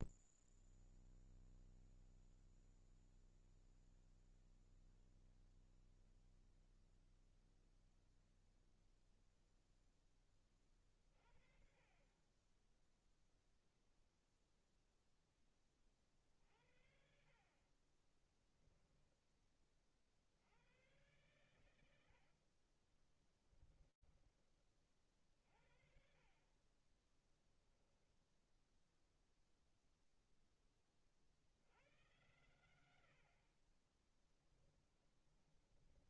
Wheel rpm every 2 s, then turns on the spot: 0, 0, 0, 0, 0, 20, 10, 0, 50, 10, 90, 50, 40, 20, 0, 20, 90, 10.
18-20 22-24 34-36